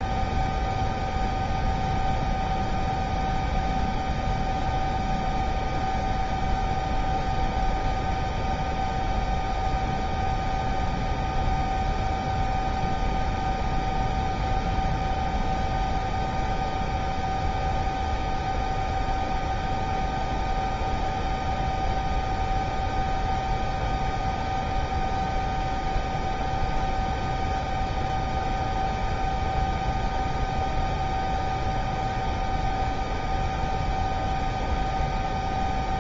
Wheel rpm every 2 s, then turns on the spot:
0, 0, 0, 0, 0, 0, 0, 0, 0, 0, 0, 0, 0, 0, 0, 0, 0, 0.
none